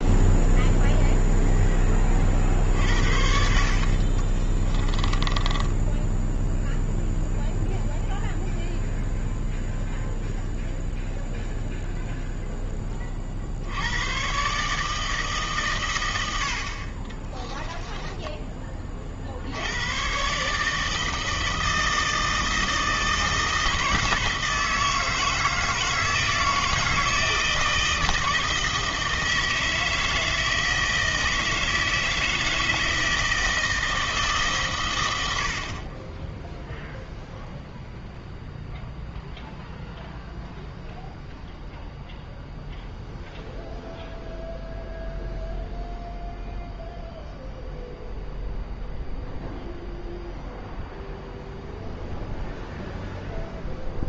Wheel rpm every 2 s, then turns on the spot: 0, 50, 30, 0, 0, 0, 0, 130, 70, 20, 140, 160, 160, 160, 160, 160, 160, 140, 0, 0, 0, 0, 0, 0, 0, 0, 0.
4-6